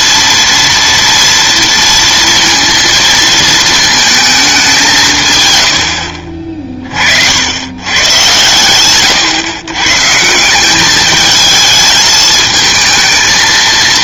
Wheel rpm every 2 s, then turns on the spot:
230, 230, 180, 40, 120, 200, 220.
none